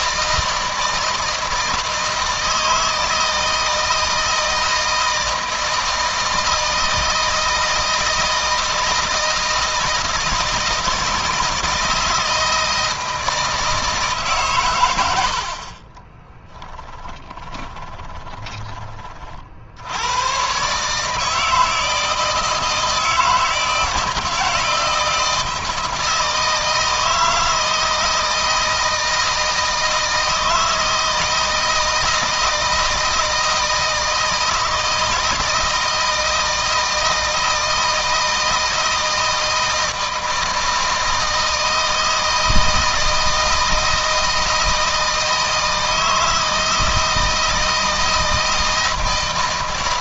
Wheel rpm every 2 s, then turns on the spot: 160, 160, 160, 160, 160, 160, 160, 100, 10, 30, 140, 160, 160, 160, 160, 160, 160, 160, 160, 160, 160, 160, 160, 160, 160.
16-18